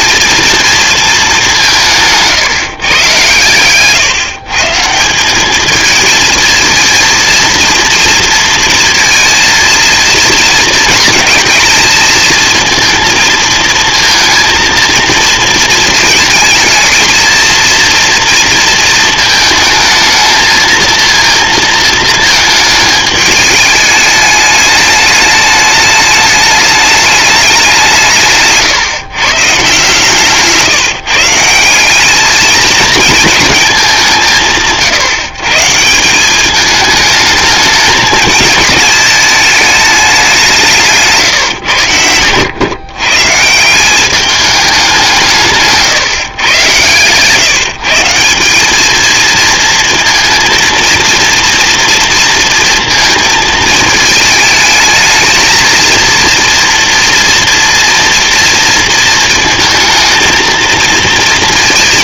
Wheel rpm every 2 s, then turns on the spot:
230, 140, 150, 230, 230, 230, 230, 230, 220, 230, 220, 220, 210, 210, 150, 150, 220, 170, 210, 210, 180, 110, 200, 130, 200, 230, 230, 220, 230, 230, 230.
none